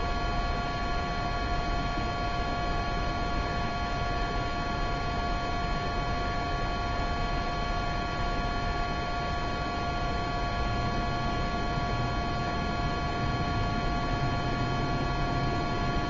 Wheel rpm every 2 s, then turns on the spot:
0, 0, 0, 0, 0, 0, 0, 0.
none